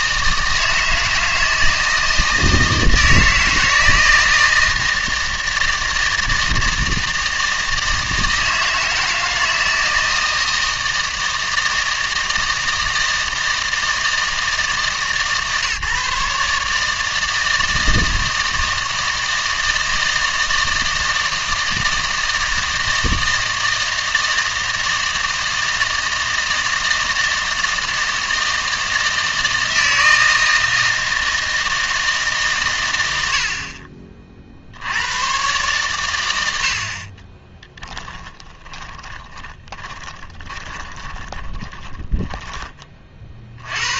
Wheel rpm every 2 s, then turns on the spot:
160, 160, 160, 160, 160, 160, 160, 160, 150, 160, 160, 160, 160, 160, 160, 160, 120, 70, 70, 20, 20, 20.
38-42